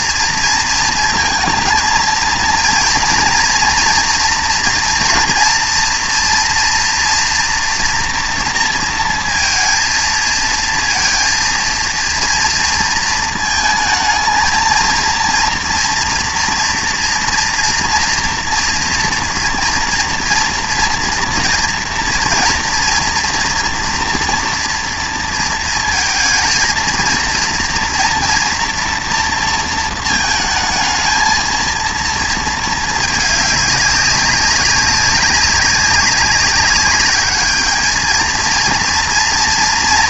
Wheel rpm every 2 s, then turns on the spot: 230, 230, 230, 230, 230, 230, 230, 220, 230, 230, 240, 230, 230, 220, 230, 220, 220, 190, 200, 230.
none